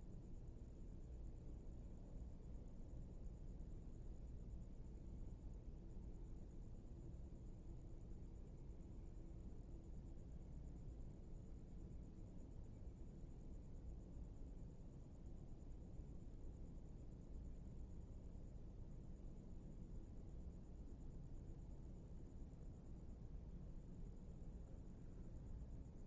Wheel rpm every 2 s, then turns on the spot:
0, 0, 0, 0, 0, 0, 0, 0, 0, 0, 0, 0, 0.
none